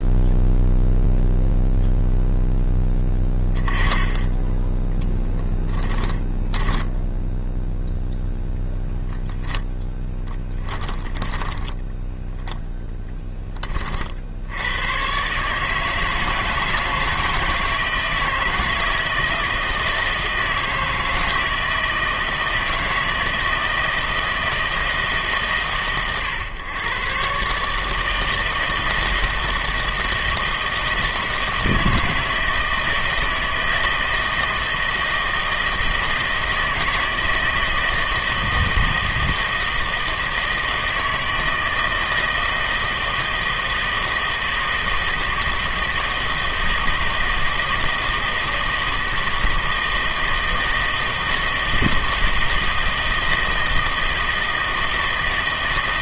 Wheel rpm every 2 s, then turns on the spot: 0, 0, 10, 10, 0, 10, 10, 100, 160, 160, 160, 160, 160, 120, 160, 160, 160, 160, 160, 160, 160, 160, 160, 160, 160, 160, 160, 160.
6-8 10-12